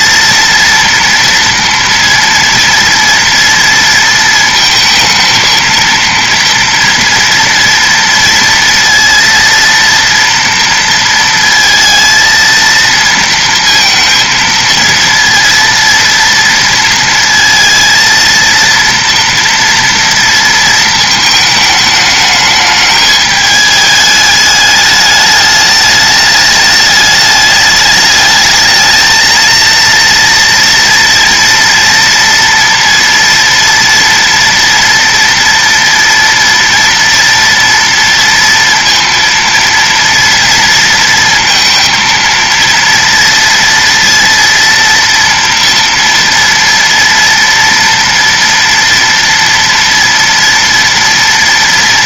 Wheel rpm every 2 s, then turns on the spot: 230, 230, 220, 230, 230, 230, 230, 230, 230, 230, 230, 210, 210, 210, 220, 230, 230, 230, 230, 230, 230, 230, 230, 230, 230, 230.
none